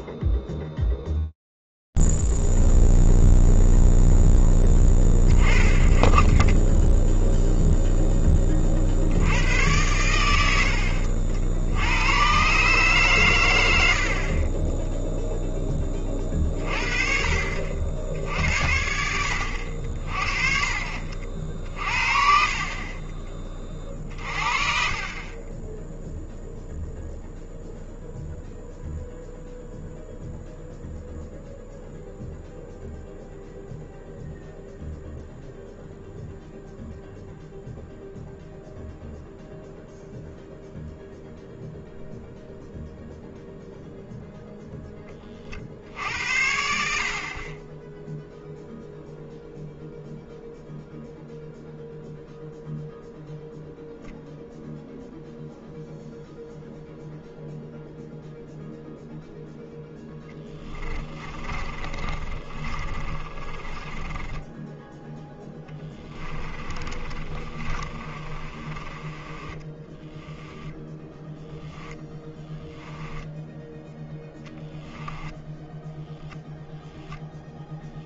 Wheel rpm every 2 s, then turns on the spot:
0, 0, 0, 20, 10, 100, 110, 60, 30, 60, 50, 40, 40, 0, 0, 0, 0, 0, 0, 0, 0, 0, 10, 60, 0, 0, 0, 0, 0, 0, 20, 30, 10, 30, 20, 10, 10, 10, 0.
22-24 60-64 66-76